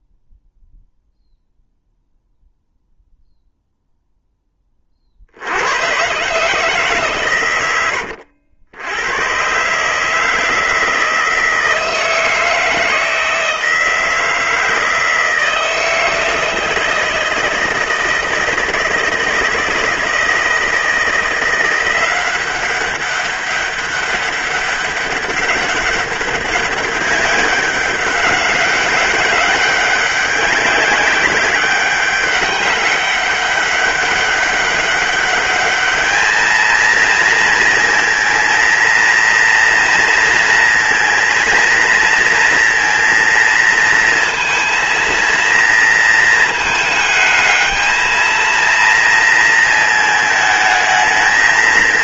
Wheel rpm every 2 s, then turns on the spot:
0, 0, 50, 150, 100, 160, 160, 160, 160, 160, 170, 190, 200, 200, 190, 190, 190, 200, 230, 230, 230, 230, 230, 220, 230, 220.
none